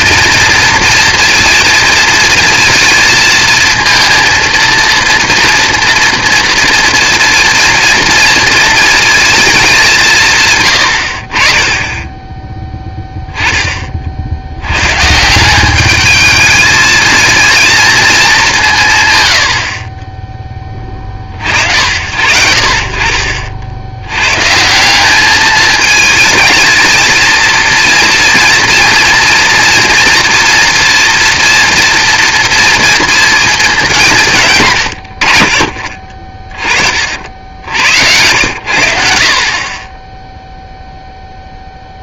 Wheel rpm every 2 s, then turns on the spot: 230, 230, 230, 230, 230, 110, 10, 100, 220, 180, 10, 60, 150, 220, 230, 230, 230, 130, 40, 90, 0.
none